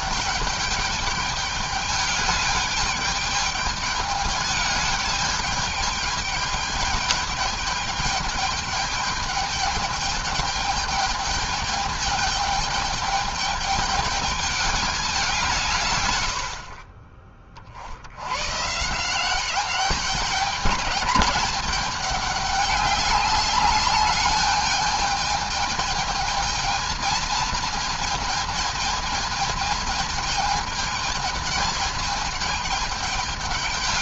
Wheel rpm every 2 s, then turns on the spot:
210, 210, 210, 210, 210, 210, 210, 210, 80, 120, 220, 210, 210, 220, 220, 220, 220.
none